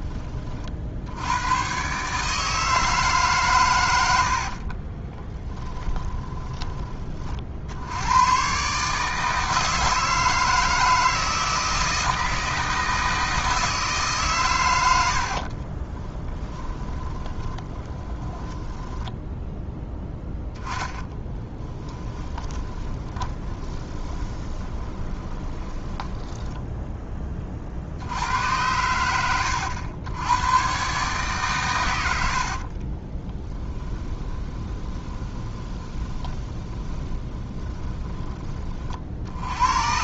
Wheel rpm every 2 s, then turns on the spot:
50, 160, 40, 30, 130, 160, 160, 100, 20, 10, 0, 10, 30, 10, 90, 130, 40, 20, 20, 40.
4-8 16-20 22-26 32-38